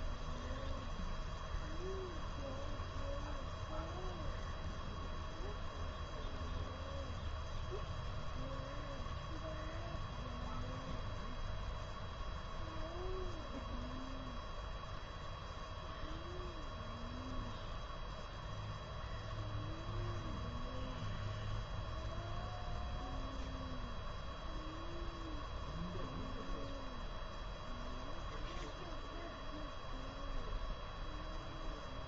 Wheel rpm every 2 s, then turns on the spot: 0, 0, 0, 0, 0, 0, 0, 0, 0, 0, 0, 0, 0, 0, 0, 0.
none